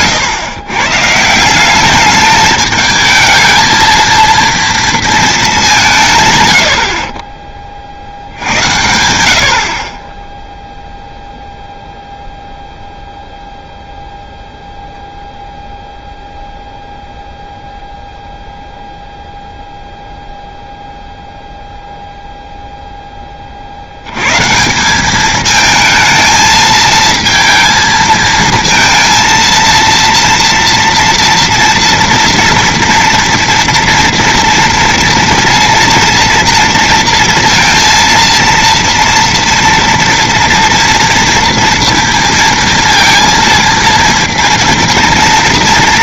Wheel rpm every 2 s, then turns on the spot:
130, 220, 230, 70, 100, 0, 0, 0, 0, 0, 0, 0, 160, 220, 230, 230, 240, 230, 230, 230, 240, 230, 230.
none